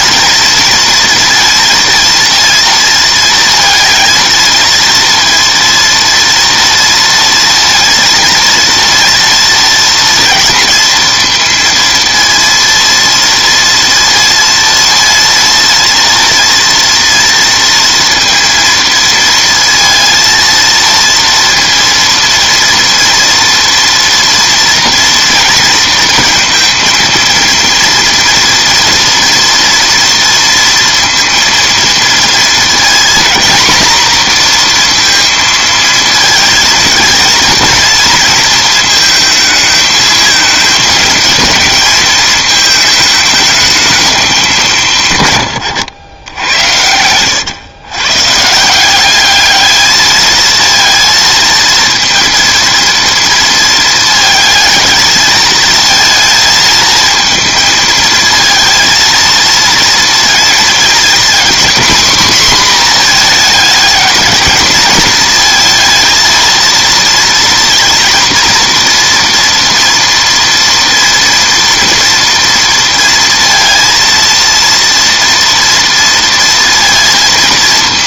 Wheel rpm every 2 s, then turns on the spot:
230, 230, 230, 230, 230, 230, 230, 230, 230, 230, 230, 230, 230, 230, 230, 230, 230, 240, 220, 220, 220, 220, 170, 90, 170, 230, 230, 220, 220, 230, 230, 240, 220, 230, 230, 230, 230, 230, 230.
none